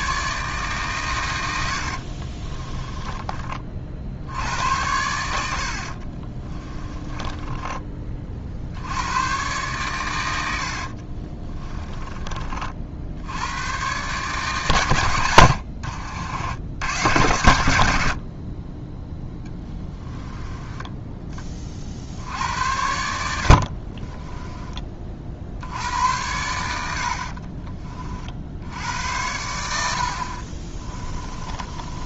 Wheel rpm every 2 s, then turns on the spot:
140, 20, 90, 20, 70, 50, 50, 120, 90, 20, 10, 80, 20, 70, 70, 30.
2-4 6-8 10-12 20-22 30-32